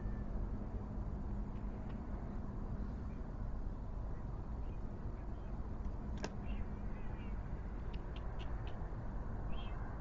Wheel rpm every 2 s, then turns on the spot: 0, 0, 0, 0, 0.
none